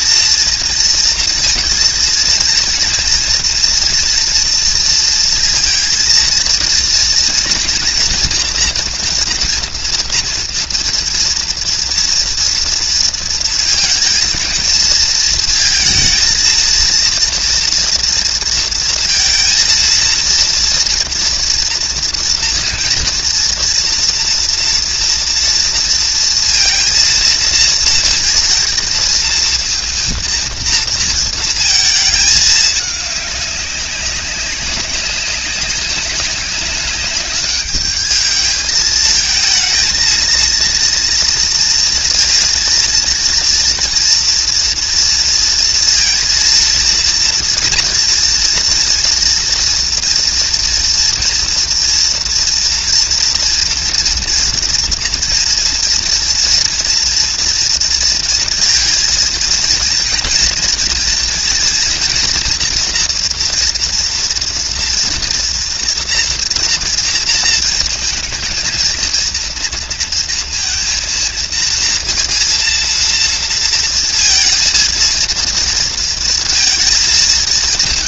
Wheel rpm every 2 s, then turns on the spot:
230, 230, 230, 230, 240, 230, 230, 220, 230, 230, 230, 230, 230, 230, 230, 230, 210, 190, 200, 220, 230, 230, 230, 230, 230, 230, 230, 230, 230, 230, 230, 230, 230, 230, 230, 230, 230, 230, 230.
none